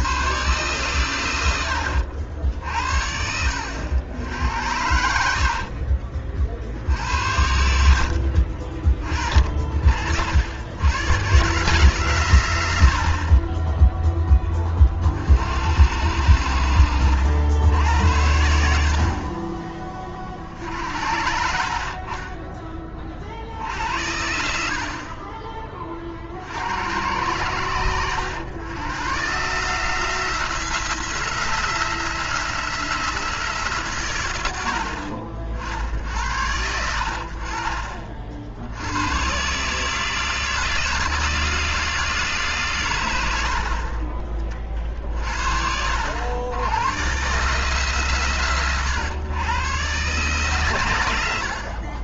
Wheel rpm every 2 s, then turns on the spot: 120, 60, 70, 60, 50, 100, 80, 30, 80, 60, 50, 20, 50, 80, 100, 160, 160, 70, 70, 90, 160, 130, 30, 100, 120, 110.
none